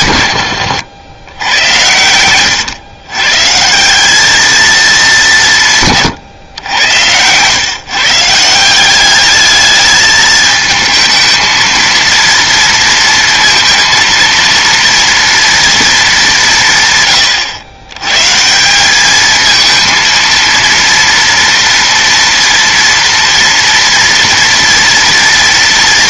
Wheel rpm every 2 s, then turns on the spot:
100, 110, 200, 110, 200, 220, 230, 230, 130, 200, 230, 230, 230.
none